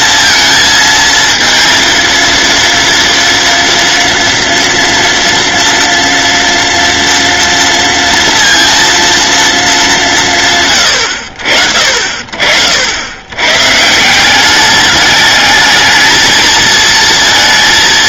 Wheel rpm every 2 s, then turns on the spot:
230, 230, 230, 230, 230, 110, 90, 210, 230.
none